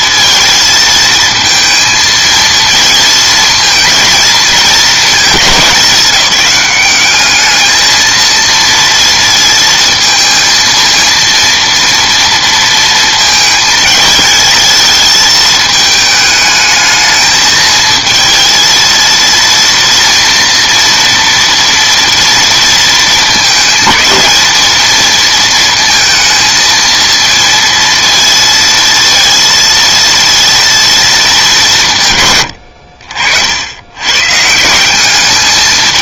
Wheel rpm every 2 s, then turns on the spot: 230, 230, 210, 200, 230, 220, 230, 220, 220, 230, 230, 230, 220, 220, 230, 230, 90, 170.
none